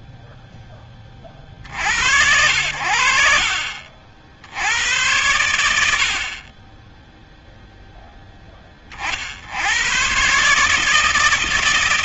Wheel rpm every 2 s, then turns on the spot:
10, 70, 100, 10, 70, 160.
none